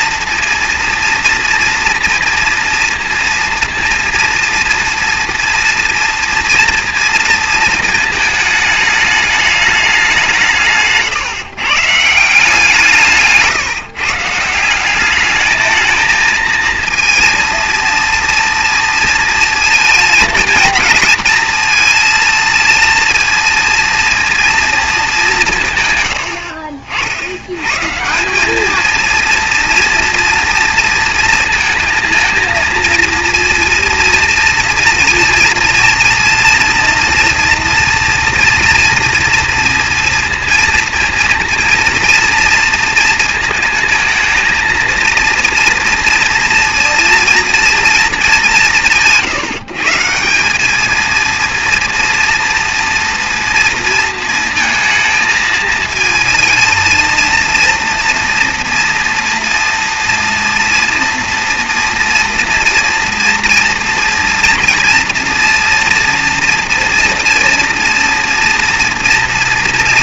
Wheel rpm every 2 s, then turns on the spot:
230, 230, 230, 230, 220, 160, 170, 170, 230, 230, 220, 230, 230, 70, 200, 230, 230, 230, 230, 230, 230, 230, 230, 230, 170, 200, 230, 230, 230, 240, 230, 230, 240, 240, 230.
none